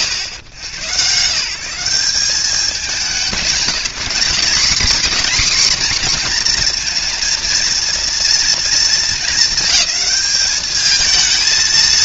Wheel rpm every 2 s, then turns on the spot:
100, 170, 190, 240, 230, 210.
none